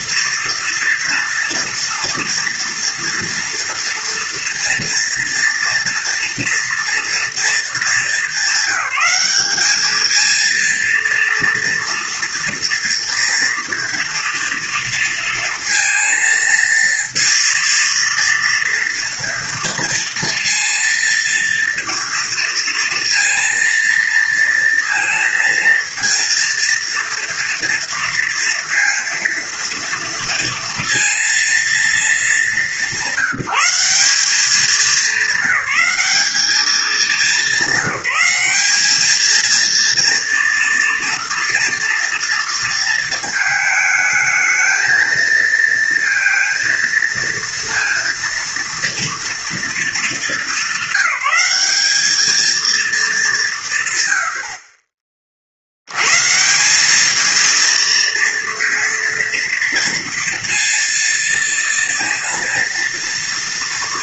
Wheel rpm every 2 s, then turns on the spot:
240, 230, 230, 230, 200, 220, 230, 230, 230, 230, 230, 230, 230, 230, 230, 230, 210, 210, 210, 200, 230, 230, 220, 230, 240, 220, 220, 70, 160, 230, 230, 230.
none